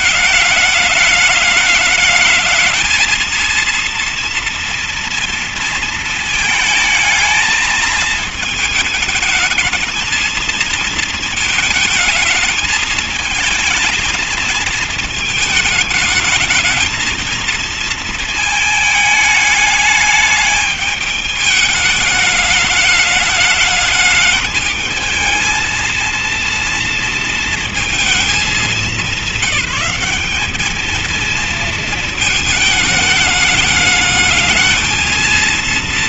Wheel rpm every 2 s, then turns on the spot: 210, 210, 230, 220, 220, 220, 220, 220, 220, 230, 210, 210, 210, 230, 220, 210, 220, 210.
none